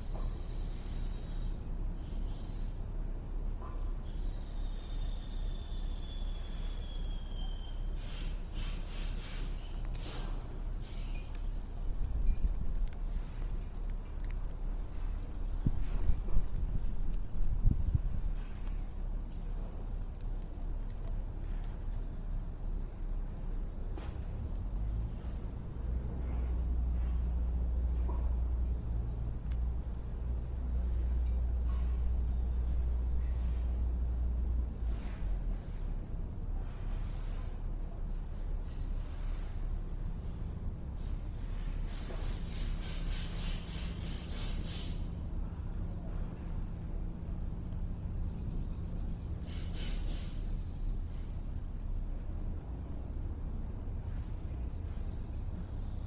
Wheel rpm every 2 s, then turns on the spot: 0, 0, 0, 0, 0, 0, 0, 0, 0, 0, 0, 0, 0, 0, 0, 0, 0, 0, 0, 0, 0, 0, 0, 0, 0, 0, 0, 0.
none